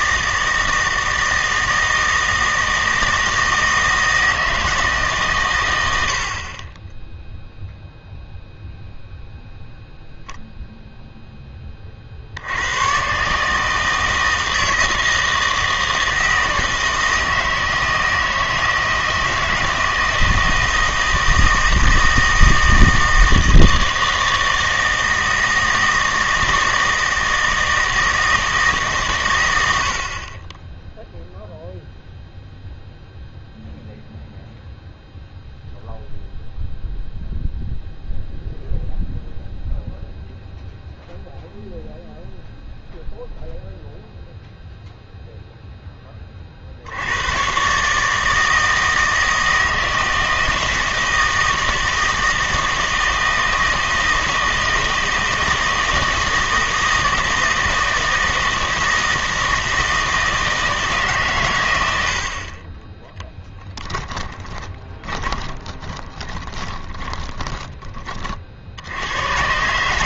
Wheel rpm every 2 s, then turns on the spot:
160, 160, 160, 30, 0, 0, 100, 160, 160, 160, 160, 160, 160, 160, 160, 20, 0, 0, 0, 0, 0, 0, 0, 50, 160, 160, 160, 160, 160, 160, 160, 30, 20, 10, 50.
64-68